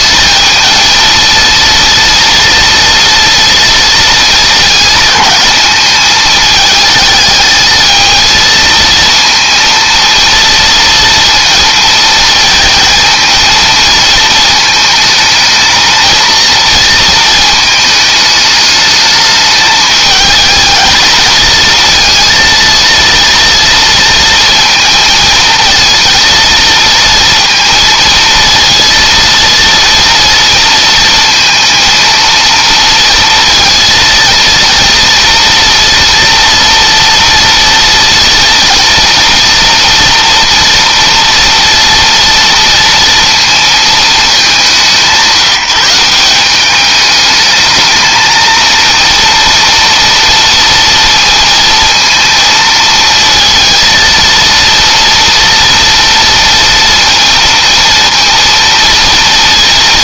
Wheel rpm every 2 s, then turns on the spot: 230, 230, 220, 220, 230, 230, 230, 220, 230, 210, 220, 230, 220, 230, 230, 230, 230, 230, 240, 230, 230, 230, 170, 200, 230, 230, 230, 230, 230, 230.
none